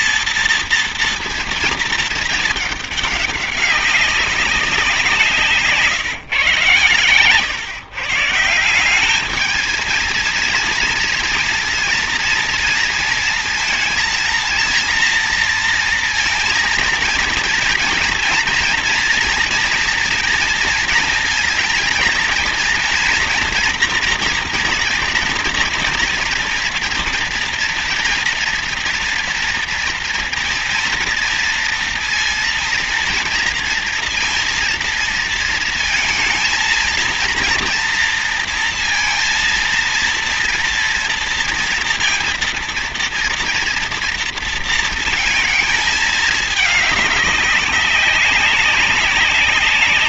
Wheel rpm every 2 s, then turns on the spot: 240, 210, 180, 120, 190, 230, 230, 230, 230, 230, 230, 230, 240, 240, 230, 230, 230, 230, 230, 230, 230, 230, 230, 210, 190.
none